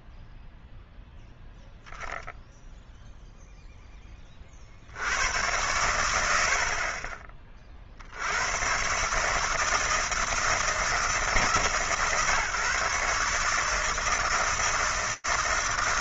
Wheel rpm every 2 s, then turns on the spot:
0, 0, 50, 70, 120, 150, 140, 160.
none